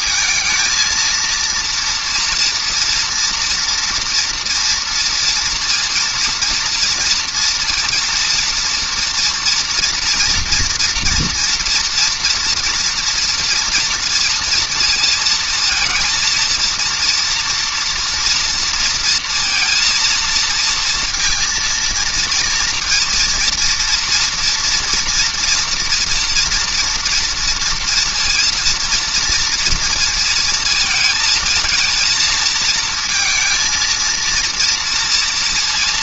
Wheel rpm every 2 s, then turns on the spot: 220, 230, 230, 230, 230, 230, 240, 230, 230, 230, 230, 230, 230, 230, 230, 230, 220, 230.
none